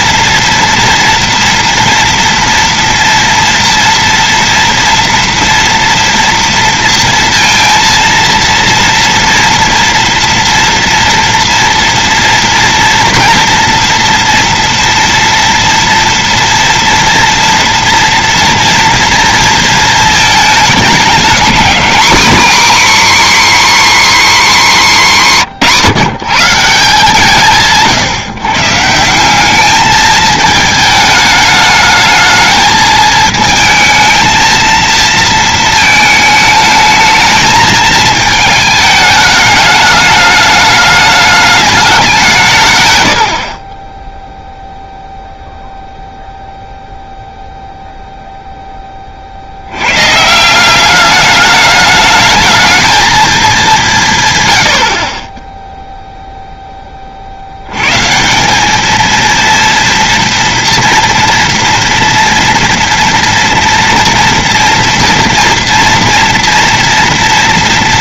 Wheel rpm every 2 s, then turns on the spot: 230, 230, 230, 230, 230, 230, 230, 230, 230, 230, 210, 280, 230, 170, 150, 220, 220, 230, 220, 220, 210, 130, 0, 0, 10, 190, 220, 90, 10, 200, 230, 230, 230, 230.
none